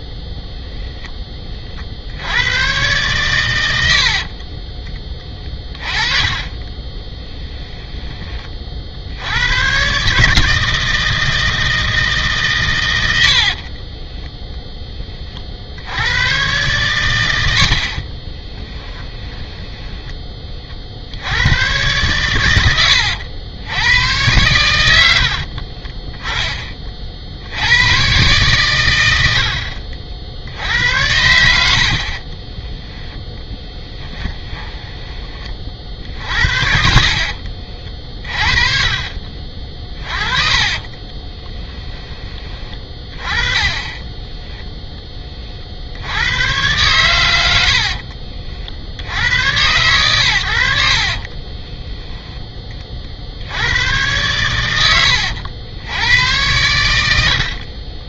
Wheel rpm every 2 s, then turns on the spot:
0, 120, 30, 20, 60, 160, 110, 10, 120, 20, 50, 90, 100, 40, 110, 70, 10, 10, 60, 40, 30, 20, 10, 110, 70, 60, 30, 100, 100.
4-8 18-20 22-26 32-34 38-42